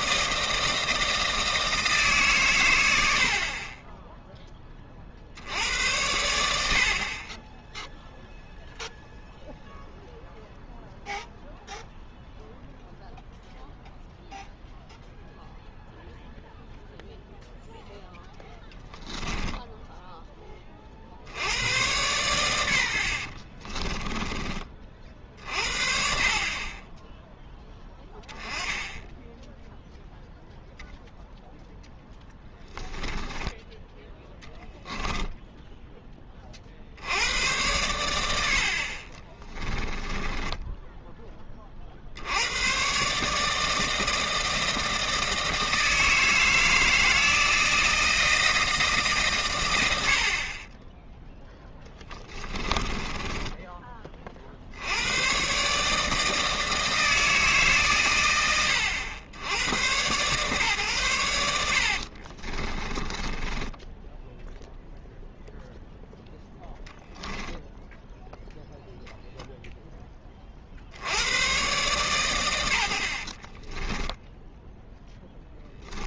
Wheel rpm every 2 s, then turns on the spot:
160, 110, 20, 70, 0, 0, 0, 0, 0, 10, 30, 100, 30, 20, 10, 0, 10, 10, 50, 70, 10, 90, 160, 160, 170, 30, 20, 60, 160, 100, 130, 30, 0, 0, 0, 30, 80, 0.
18-20 32-34 40-42 52-54 62-64